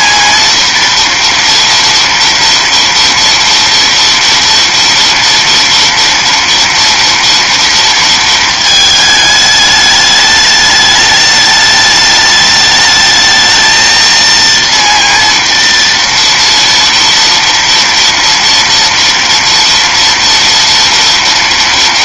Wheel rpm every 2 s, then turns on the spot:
230, 230, 230, 230, 220, 210, 210, 230, 230, 230, 230.
none